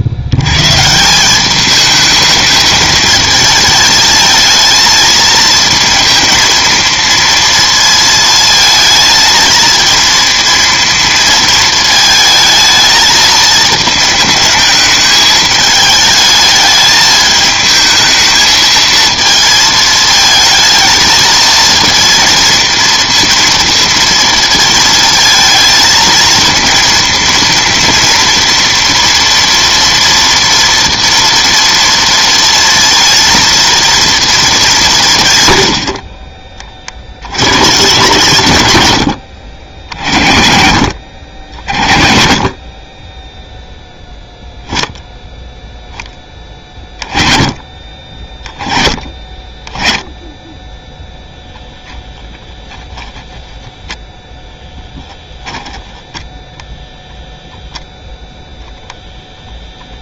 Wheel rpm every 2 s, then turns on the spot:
110, 220, 220, 230, 220, 230, 220, 220, 210, 220, 220, 220, 230, 230, 230, 230, 230, 210, 40, 110, 70, 30, 0, 20, 20, 10, 10, 10, 0, 0.
38-40